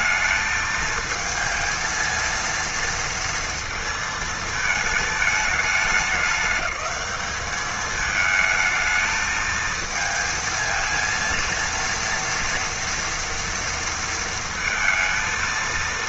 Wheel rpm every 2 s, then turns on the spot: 220, 230, 220, 210, 220, 230, 230, 230.
none